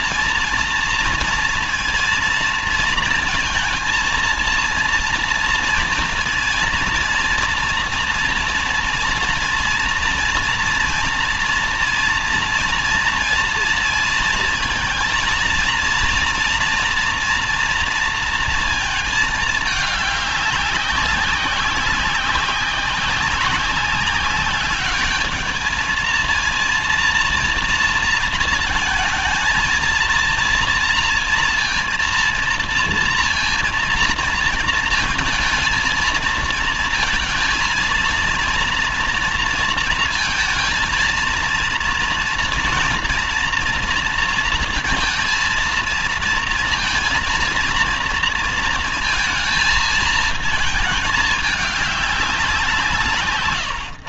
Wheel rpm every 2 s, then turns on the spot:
230, 230, 230, 230, 230, 240, 230, 230, 230, 230, 200, 190, 200, 230, 230, 230, 230, 230, 230, 230, 230, 240, 230, 230, 230, 220, 180.
none